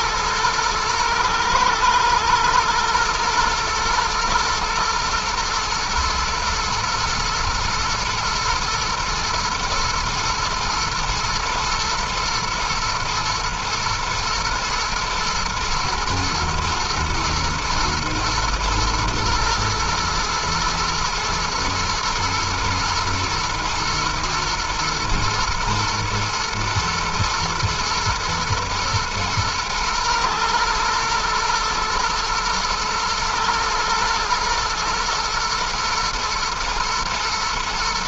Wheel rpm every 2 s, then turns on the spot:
110, 120, 110, 120, 120, 110, 120, 120, 110, 110, 110, 120, 110, 110, 120, 110, 120, 110, 110.
none